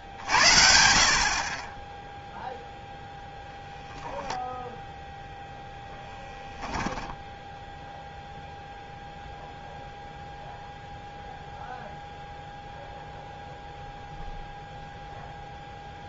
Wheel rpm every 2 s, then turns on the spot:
60, 0, 0, 10, 0, 0, 0, 0.
6-8